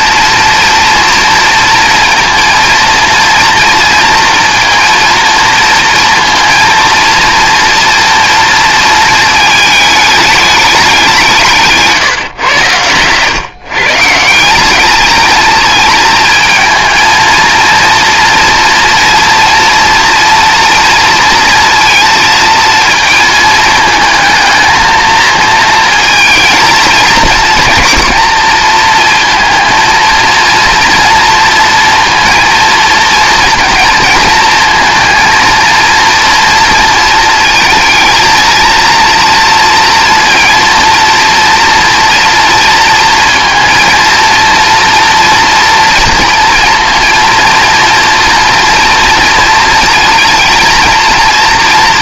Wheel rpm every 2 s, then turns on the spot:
240, 240, 230, 230, 230, 200, 110, 200, 220, 230, 230, 230, 220, 230, 230, 230, 230, 230, 230, 230, 230, 230, 230, 230, 230, 230.
12-14